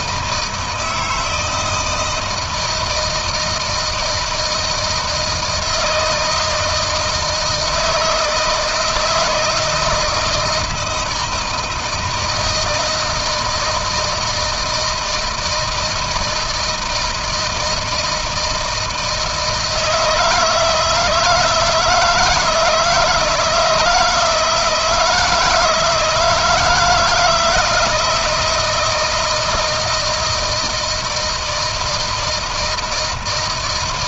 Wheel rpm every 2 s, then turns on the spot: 160, 160, 160, 160, 160, 160, 160, 160, 160, 160, 160, 160, 160, 160, 170, 160, 160.
none